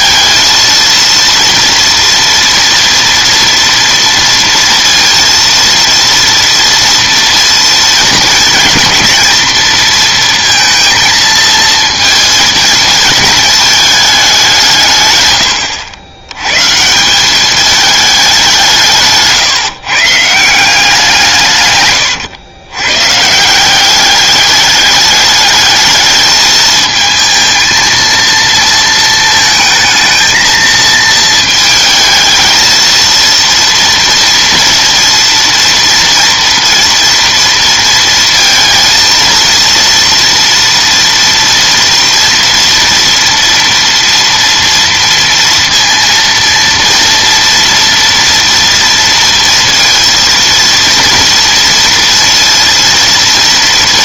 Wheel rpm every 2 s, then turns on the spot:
230, 230, 230, 230, 220, 230, 220, 170, 130, 180, 180, 110, 210, 220, 230, 220, 220, 230, 230, 230, 230, 230, 230, 230, 230, 230, 230.
none